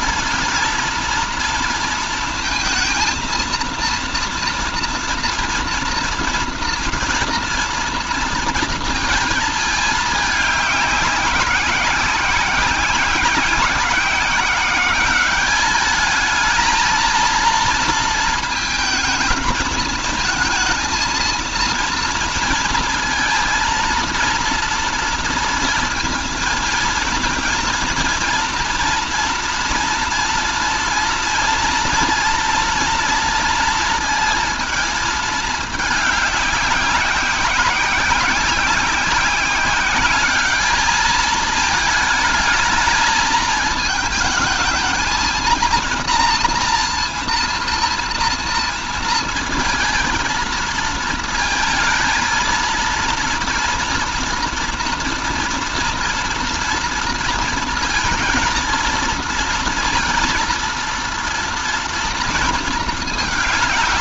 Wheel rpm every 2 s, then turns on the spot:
230, 230, 230, 240, 230, 200, 190, 190, 220, 220, 230, 230, 230, 230, 230, 230, 230, 220, 200, 190, 210, 220, 220, 230, 230, 220, 230, 230, 230, 230, 230, 220.
none